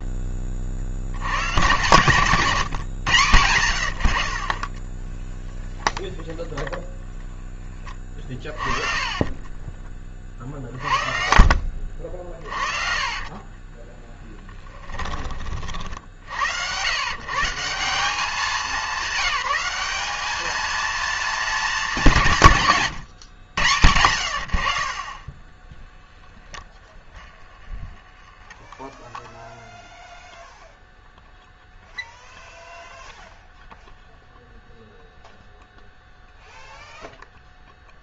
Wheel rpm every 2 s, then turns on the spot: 40, 130, 20, 0, 50, 40, 30, 10, 110, 210, 220, 160, 60, 10, 0, 0, 0, 0, 0.
8-10 12-16 26-28